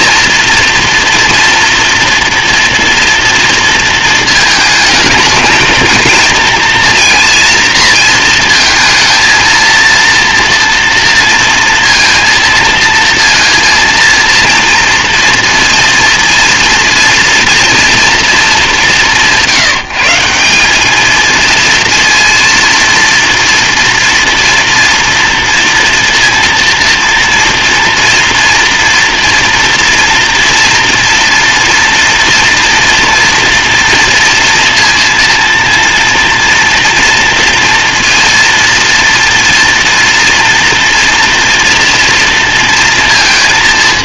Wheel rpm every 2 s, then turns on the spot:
230, 230, 230, 230, 230, 230, 230, 230, 230, 230, 180, 230, 230, 230, 230, 230, 240, 230, 230, 230, 240, 230.
none